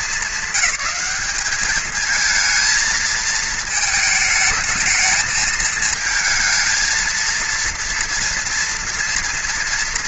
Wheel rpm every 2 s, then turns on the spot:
200, 220, 220, 230, 230.
none